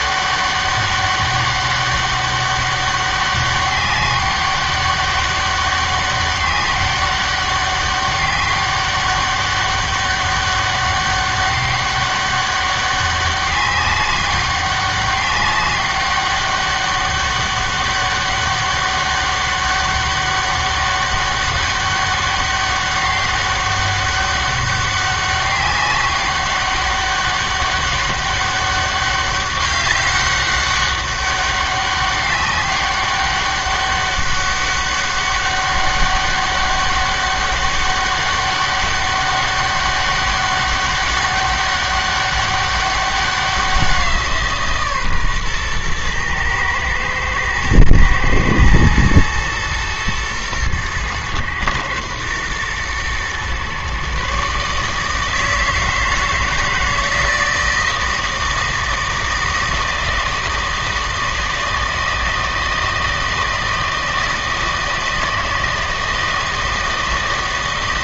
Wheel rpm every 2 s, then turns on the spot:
200, 200, 200, 200, 190, 200, 200, 200, 200, 200, 200, 200, 200, 200, 200, 200, 200, 200, 200, 200, 200, 200, 160, 110, 120, 110, 120, 140, 160, 160, 160, 160, 160, 160.
none